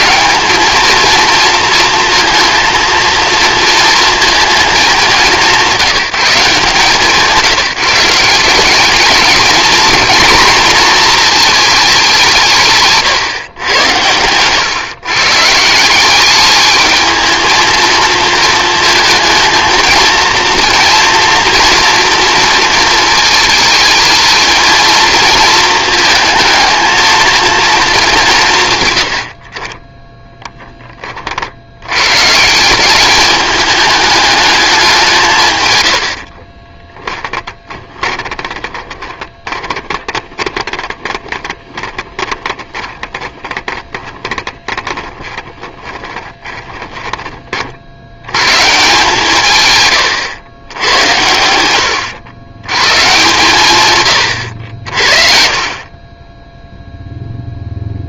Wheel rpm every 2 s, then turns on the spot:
230, 230, 210, 170, 180, 240, 150, 120, 210, 230, 230, 230, 230, 220, 140, 10, 170, 200, 30, 20, 20, 20, 20, 20, 140, 100, 110, 80, 0.
36-48 54-56